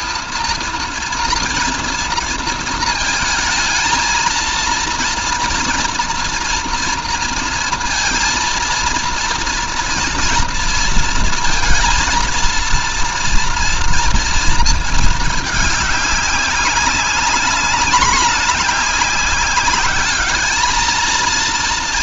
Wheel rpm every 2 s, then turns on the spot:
230, 230, 230, 230, 230, 230, 230, 210, 200, 200, 230.
none